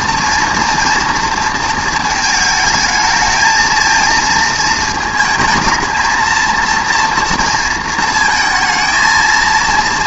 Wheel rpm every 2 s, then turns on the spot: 240, 220, 230, 230, 230.
none